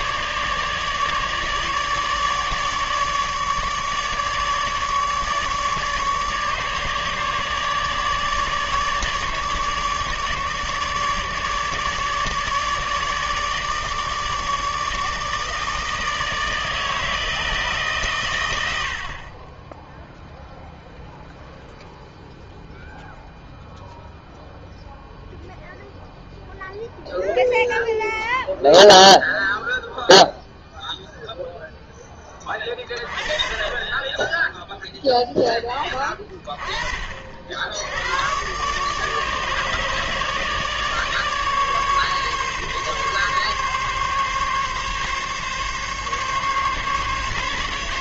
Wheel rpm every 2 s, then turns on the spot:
150, 150, 150, 150, 150, 150, 150, 160, 160, 100, 0, 0, 0, 0, 0, 0, 20, 0, 30, 130, 150, 140, 140, 140.
none